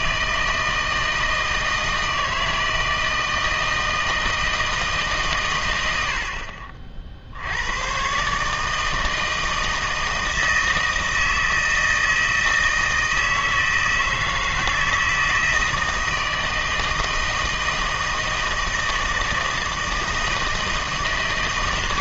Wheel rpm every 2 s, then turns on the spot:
160, 160, 160, 40, 150, 160, 160, 160, 160, 160, 160.
none